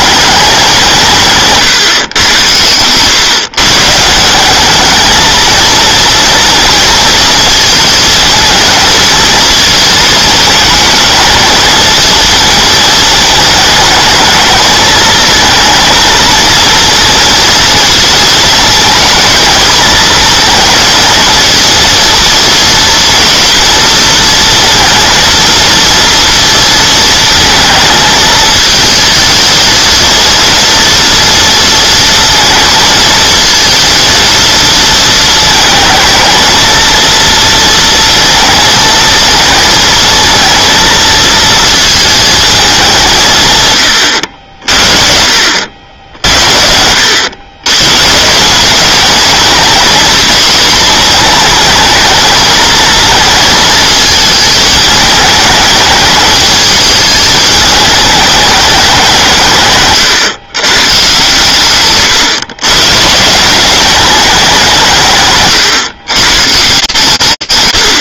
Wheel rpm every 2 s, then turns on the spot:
200, 110, 200, 230, 220, 220, 220, 220, 230, 220, 220, 230, 230, 230, 220, 230, 220, 230, 220, 230, 230, 210, 50, 70, 200, 240, 220, 210, 210, 200, 120, 120, 170, 140.
none